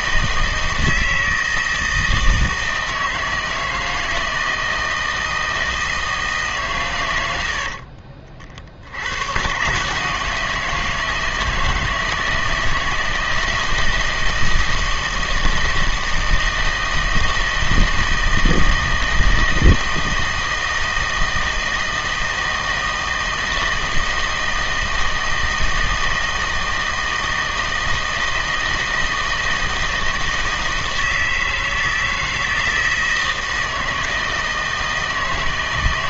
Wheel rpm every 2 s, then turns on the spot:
160, 160, 160, 120, 70, 160, 160, 160, 160, 160, 160, 160, 160, 160, 160, 160, 160, 160.
none